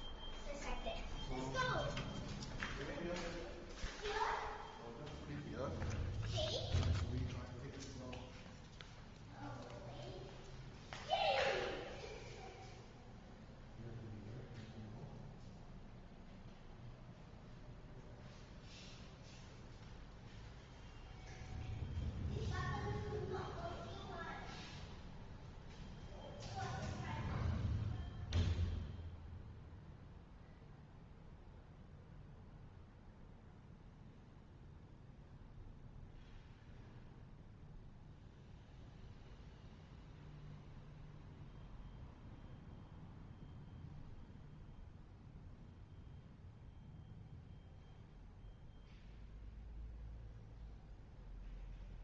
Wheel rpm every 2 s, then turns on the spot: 0, 0, 0, 0, 0, 0, 0, 0, 0, 0, 0, 0, 0, 0, 0, 0, 0, 0, 0, 0, 0, 0, 0, 0, 0, 0.
none